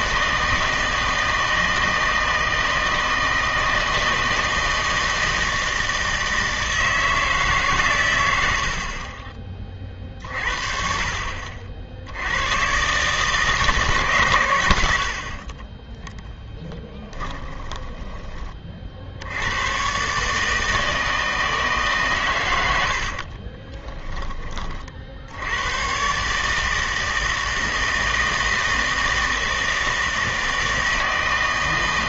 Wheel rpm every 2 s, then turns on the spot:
160, 160, 160, 160, 90, 50, 100, 130, 0, 30, 150, 100, 20, 150, 160, 160.
none